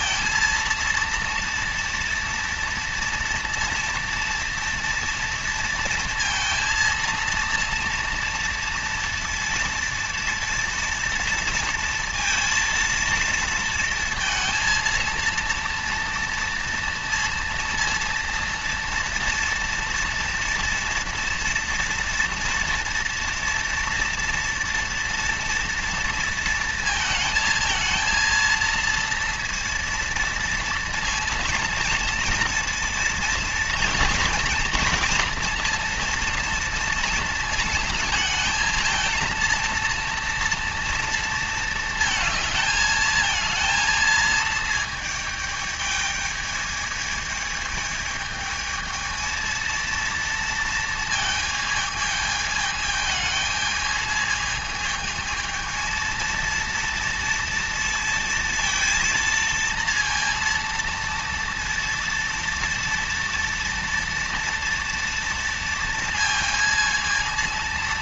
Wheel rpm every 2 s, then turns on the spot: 230, 230, 230, 230, 230, 230, 230, 230, 230, 230, 230, 230, 230, 230, 230, 230, 230, 230, 230, 230, 230, 220, 220, 220, 220, 230, 220, 220, 230, 230, 230, 230, 230, 220.
none